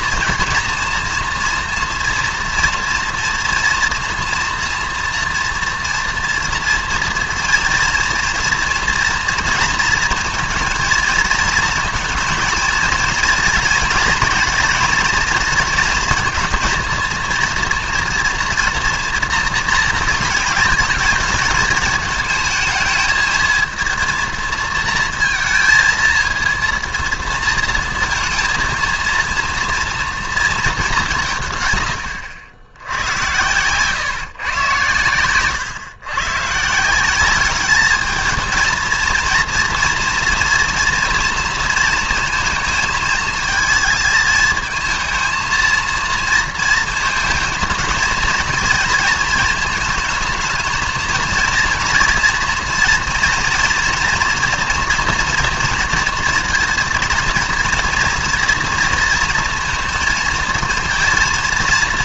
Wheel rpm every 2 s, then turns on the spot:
230, 230, 230, 230, 240, 230, 230, 230, 230, 230, 220, 220, 230, 230, 230, 210, 90, 120, 160, 230, 230, 220, 220, 230, 220, 220, 230, 230, 230, 230, 230.
none